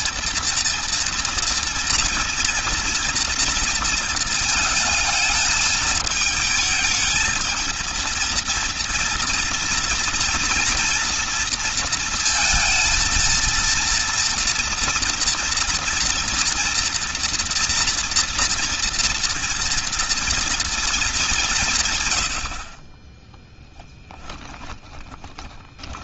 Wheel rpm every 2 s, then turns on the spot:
230, 230, 220, 220, 230, 240, 230, 230, 230, 230, 230, 40, 20.
24-26